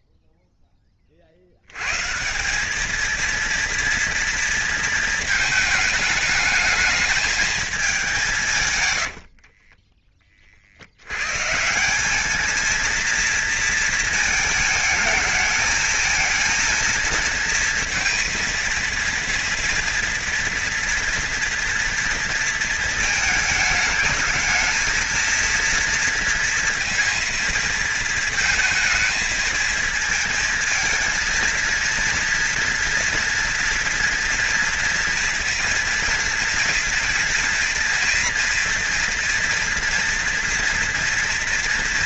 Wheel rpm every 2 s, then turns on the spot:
20, 210, 230, 210, 130, 70, 230, 220, 230, 230, 240, 220, 220, 230, 220, 220, 230, 240, 230, 240, 230.
8-10